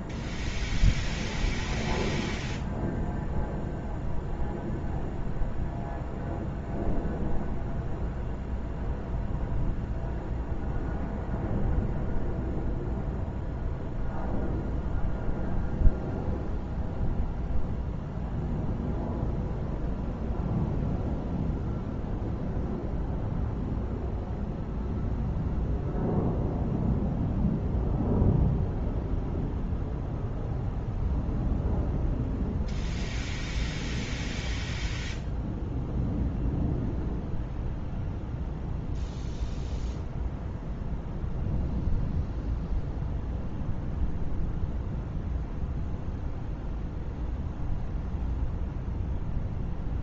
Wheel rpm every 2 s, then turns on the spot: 0, 0, 0, 0, 0, 0, 0, 0, 0, 0, 0, 0, 0, 0, 0, 0, 0, 0, 0, 0, 0, 0, 0, 0, 0.
none